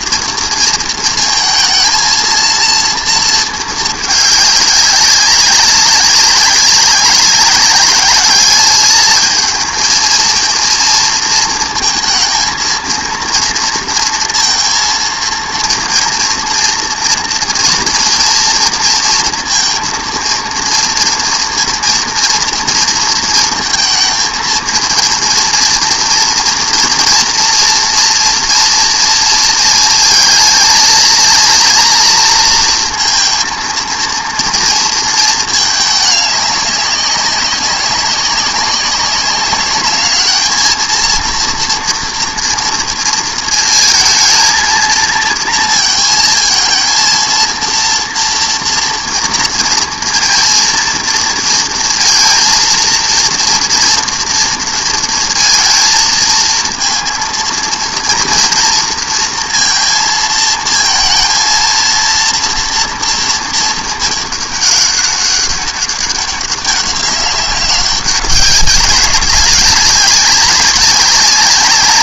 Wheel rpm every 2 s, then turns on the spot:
230, 230, 210, 200, 210, 230, 230, 230, 230, 240, 230, 230, 230, 230, 230, 230, 230, 230, 200, 190, 220, 230, 230, 220, 230, 230, 220, 230, 230, 230, 220, 230, 210, 200, 190, 200.
none